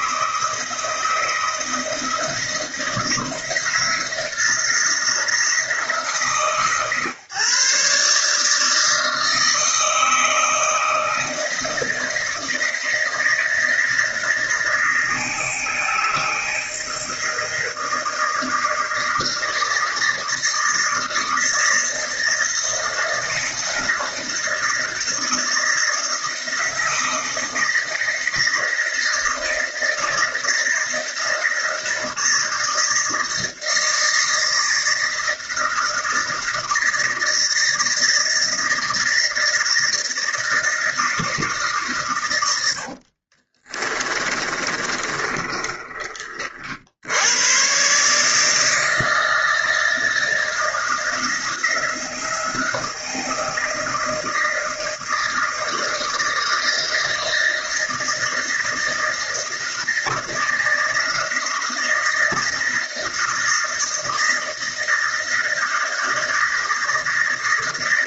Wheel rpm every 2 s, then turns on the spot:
160, 160, 170, 140, 160, 160, 160, 160, 160, 160, 160, 160, 160, 160, 160, 160, 160, 160, 160, 160, 160, 70, 30, 70, 160, 160, 160, 160, 160, 160, 160, 160, 160, 160.
42-46